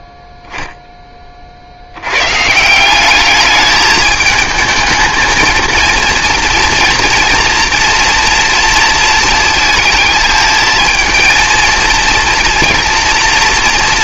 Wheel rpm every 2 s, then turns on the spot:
0, 170, 220, 230, 230, 220, 230.
none